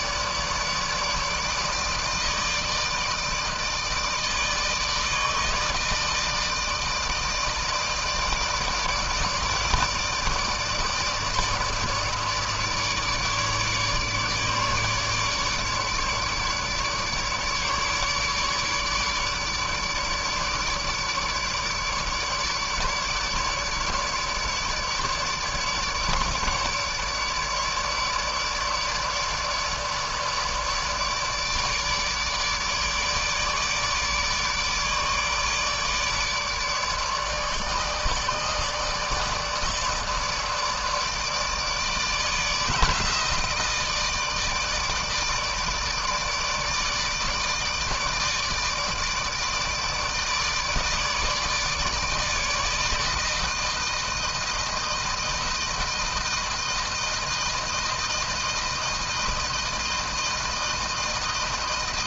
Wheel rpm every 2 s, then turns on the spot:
150, 160, 160, 160, 160, 150, 150, 150, 150, 150, 150, 150, 150, 150, 150, 150, 150, 150, 150, 150, 160, 160, 160, 150, 160, 150, 160, 160, 160, 160, 160.
none